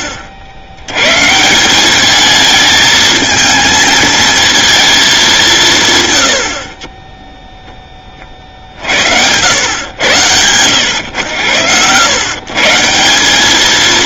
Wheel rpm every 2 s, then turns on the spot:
80, 220, 220, 60, 50, 110, 150.
none